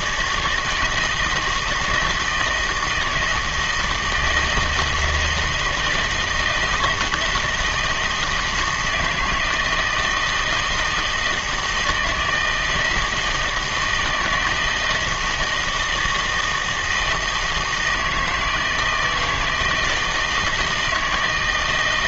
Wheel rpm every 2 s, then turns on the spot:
160, 160, 160, 170, 160, 160, 160, 160, 160, 160, 160.
none